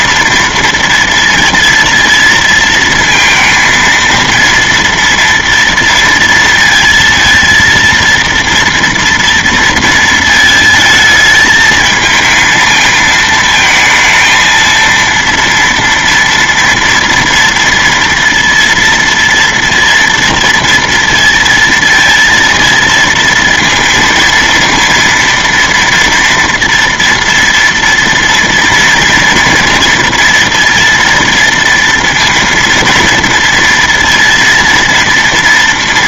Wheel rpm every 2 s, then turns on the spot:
230, 230, 230, 230, 230, 220, 220, 230, 230, 230, 230, 230, 230, 230, 230, 240, 230, 230.
none